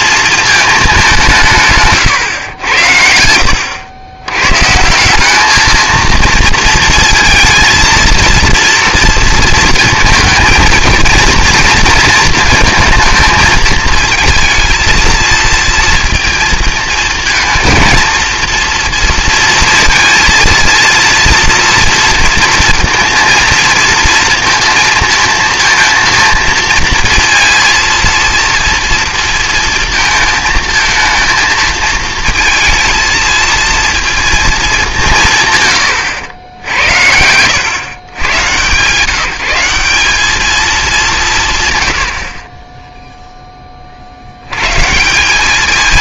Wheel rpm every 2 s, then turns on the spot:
220, 100, 130, 230, 230, 230, 230, 230, 230, 230, 230, 230, 230, 230, 240, 230, 220, 210, 80, 150, 210, 30, 110.
none